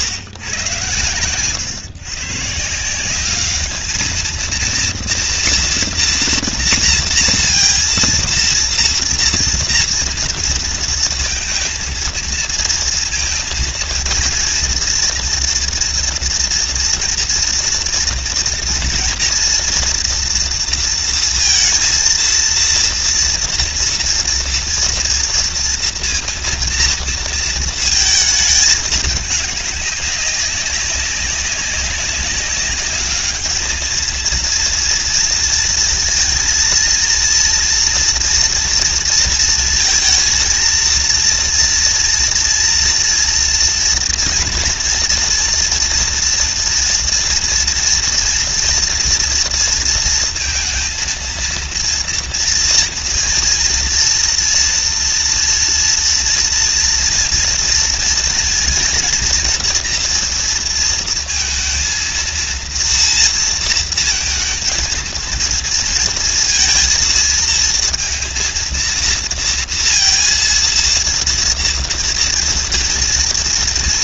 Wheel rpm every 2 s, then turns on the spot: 120, 140, 230, 230, 230, 230, 230, 230, 230, 240, 230, 230, 230, 230, 220, 200, 200, 230, 230, 240, 230, 230, 230, 230, 240, 230, 230, 230, 230, 230, 230, 230, 220, 230, 230, 230, 230.
none